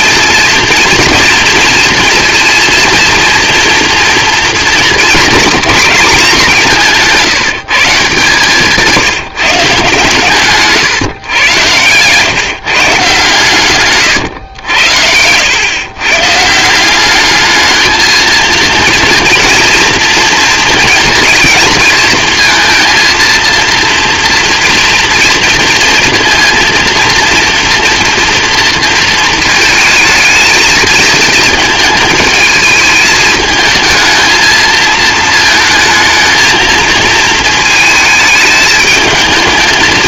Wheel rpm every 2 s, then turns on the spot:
230, 230, 230, 200, 150, 140, 140, 120, 140, 230, 230, 230, 230, 230, 230, 220, 220, 220, 230, 220.
10-12 14-16